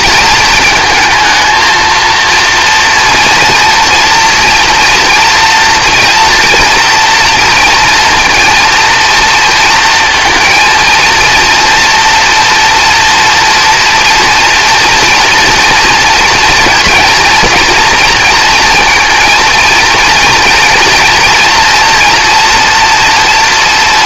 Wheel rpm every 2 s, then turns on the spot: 230, 230, 230, 230, 230, 230, 240, 240, 230, 240, 240, 230.
none